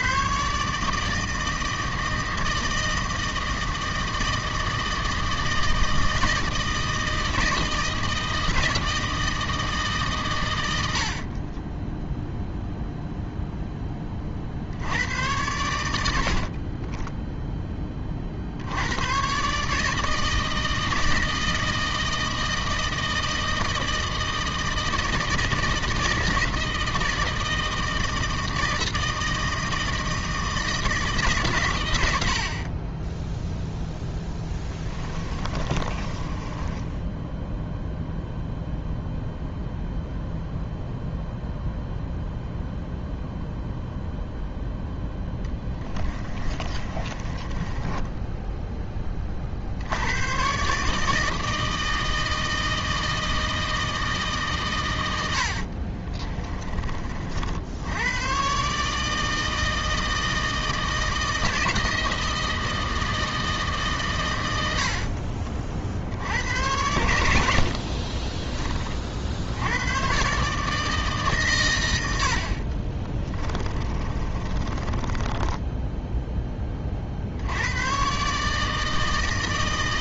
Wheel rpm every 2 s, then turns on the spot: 150, 160, 160, 160, 160, 90, 0, 70, 30, 90, 160, 160, 160, 160, 160, 160, 40, 10, 10, 0, 0, 0, 0, 30, 10, 140, 160, 120, 40, 140, 160, 160, 80, 90, 30, 150, 30, 20, 30, 160.
16-18 34-38 46-48 64-66 72-76